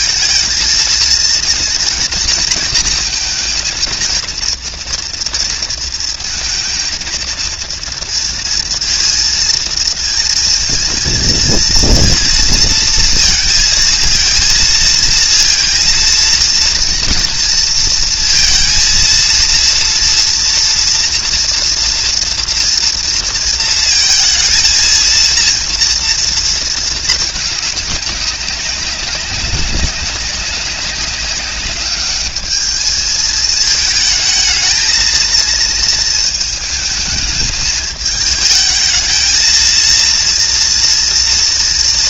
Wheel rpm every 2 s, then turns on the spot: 230, 230, 230, 230, 230, 230, 230, 230, 230, 230, 230, 230, 230, 220, 190, 200, 210, 220, 220, 220, 230.
none